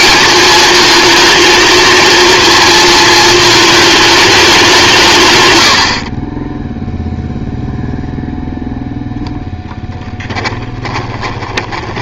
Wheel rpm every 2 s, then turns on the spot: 220, 230, 180, 0, 0, 20.
10-12